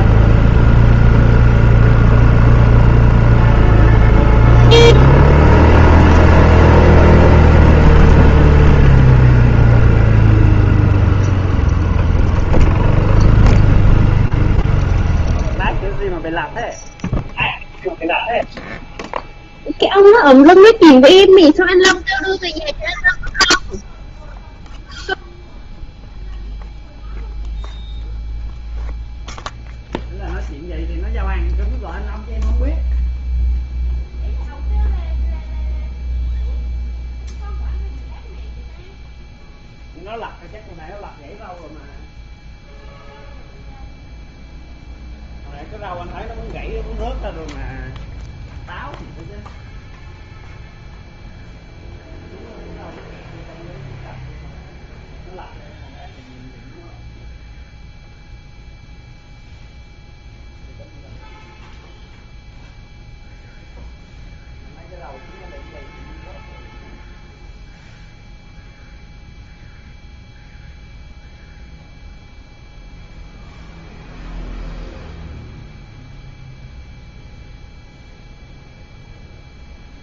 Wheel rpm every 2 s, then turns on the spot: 0, 0, 0, 0, 0, 0, 0, 0, 0, 0, 0, 0, 0, 0, 0, 0, 0, 0, 0, 0, 0, 0, 0, 0, 0, 0, 0, 0, 0, 0, 0, 0, 0, 0, 0, 0, 0, 0, 0, 0.
none